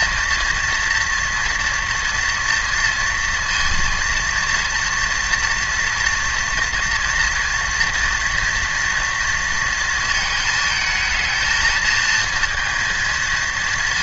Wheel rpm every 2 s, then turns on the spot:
230, 230, 230, 240, 230, 220, 230.
none